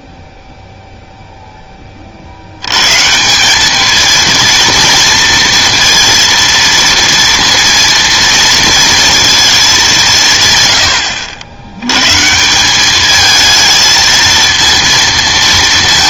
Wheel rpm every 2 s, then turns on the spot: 0, 100, 230, 230, 230, 120, 190, 230.
none